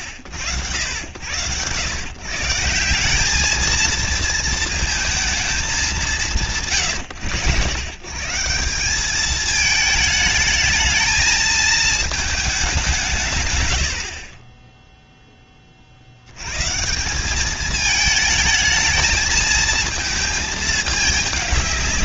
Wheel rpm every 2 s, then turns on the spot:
80, 150, 230, 130, 150, 210, 210, 40, 100, 220, 220.
none